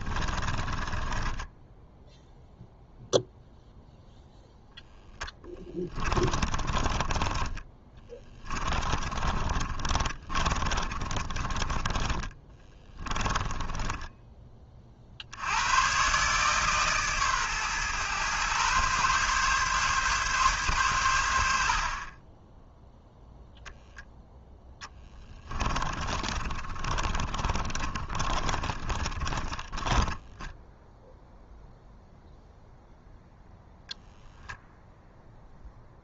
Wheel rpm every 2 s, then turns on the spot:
20, 0, 0, 30, 30, 30, 20, 30, 140, 130, 130, 10, 0, 30, 40, 10, 0, 0.
0-2 6-14 26-30